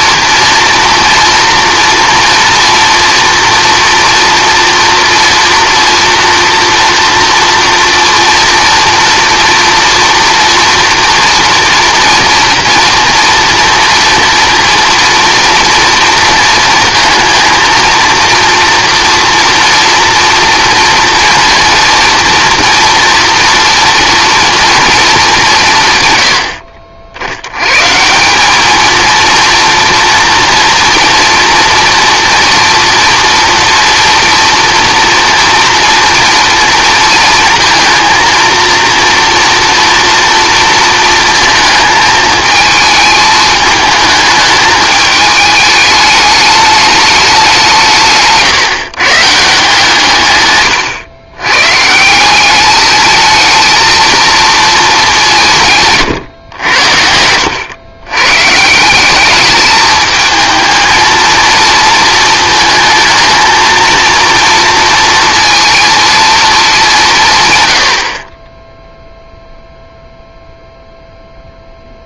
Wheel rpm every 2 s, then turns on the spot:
230, 230, 240, 230, 230, 230, 230, 230, 230, 230, 230, 230, 230, 60, 210, 230, 230, 230, 230, 230, 230, 220, 210, 210, 160, 120, 200, 220, 90, 160, 220, 220, 230, 220, 10, 0.
50-52